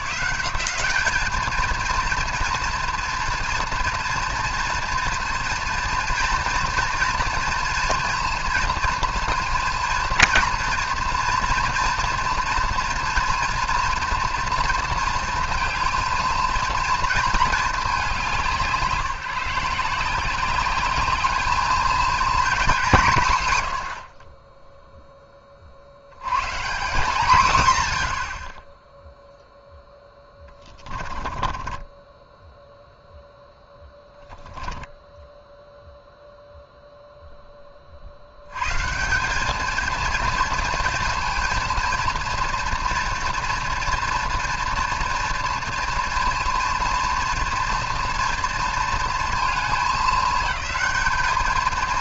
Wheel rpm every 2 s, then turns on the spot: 190, 230, 230, 230, 230, 230, 230, 230, 220, 160, 200, 210, 10, 170, 10, 10, 0, 0, 0, 160, 230, 230, 230, 230, 230, 200.
30-32